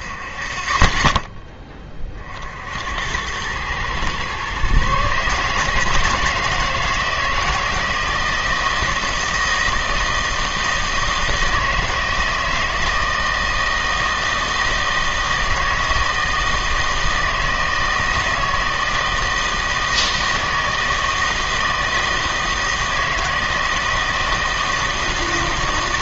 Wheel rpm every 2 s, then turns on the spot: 20, 70, 130, 160, 160, 160, 160, 160, 160, 160, 160, 160, 160.
none